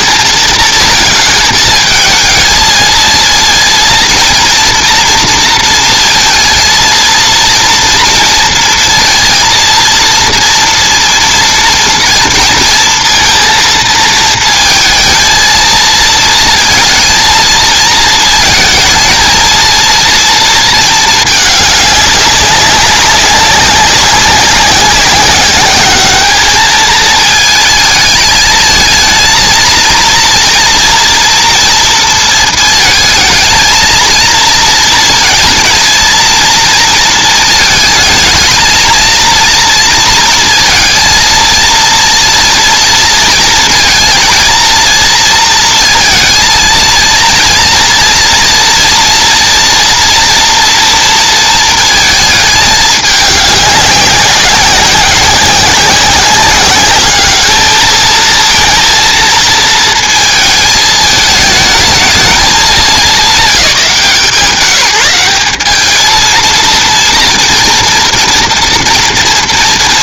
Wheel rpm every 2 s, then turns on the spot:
230, 220, 230, 230, 230, 230, 230, 230, 230, 230, 230, 200, 190, 210, 220, 230, 230, 230, 230, 220, 230, 230, 230, 220, 230, 240, 210, 190, 190, 230, 220, 200, 180, 230, 240.
none